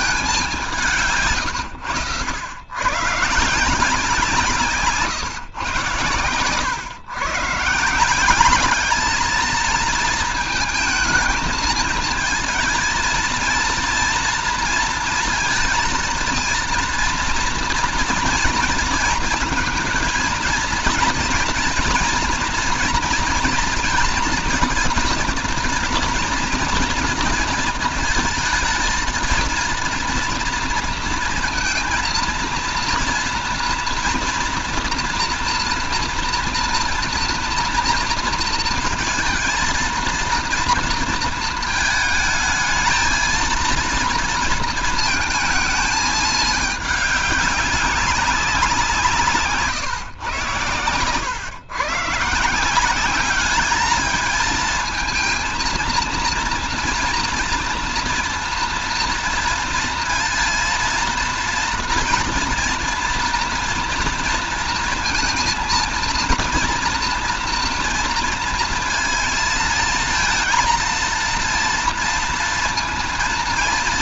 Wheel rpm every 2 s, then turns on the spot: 180, 100, 160, 110, 190, 220, 230, 230, 230, 230, 230, 230, 230, 230, 220, 230, 230, 230, 240, 230, 230, 220, 230, 210, 180, 110, 150, 220, 230, 230, 230, 240, 230, 230, 230, 230, 230.
none